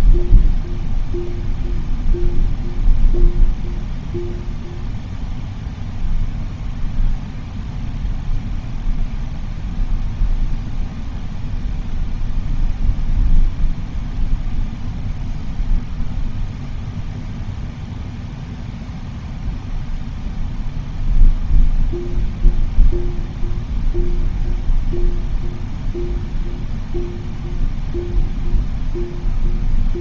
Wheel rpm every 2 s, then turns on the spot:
0, 0, 0, 0, 0, 0, 0, 0, 0, 0, 0, 0, 0, 0, 0.
none